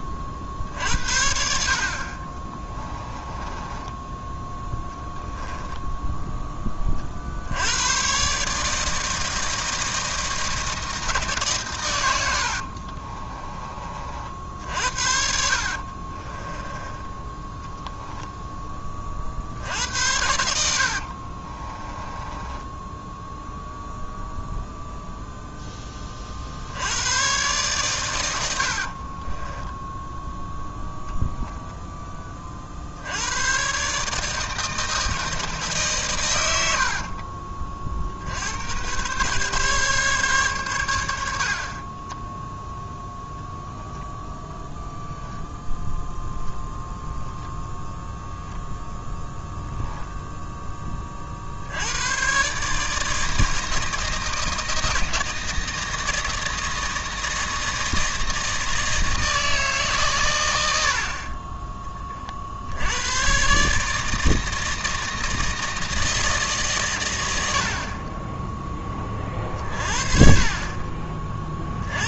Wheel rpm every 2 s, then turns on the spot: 50, 20, 10, 20, 150, 160, 60, 60, 10, 10, 70, 10, 0, 70, 70, 0, 30, 160, 80, 100, 110, 0, 0, 0, 0, 10, 140, 160, 160, 160, 70, 70, 160, 140, 10, 30.
2-4 12-18 22-24 28-30 36-38